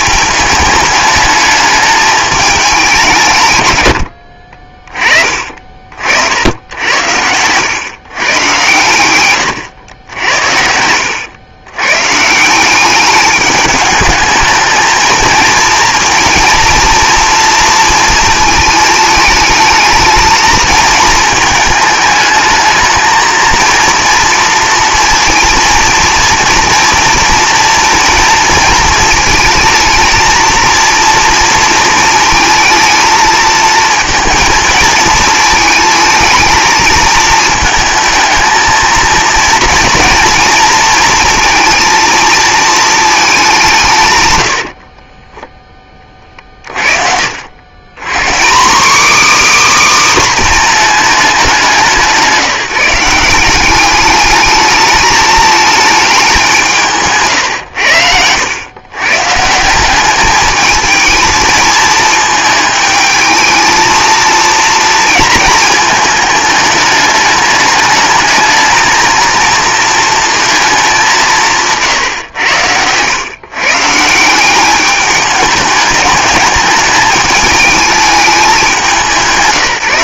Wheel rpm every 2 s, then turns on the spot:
210, 190, 30, 80, 130, 80, 190, 220, 230, 220, 220, 220, 230, 230, 230, 230, 220, 220, 220, 220, 230, 220, 70, 50, 230, 250, 180, 210, 180, 110, 220, 220, 230, 220, 220, 220, 100, 200, 210, 200.
10-12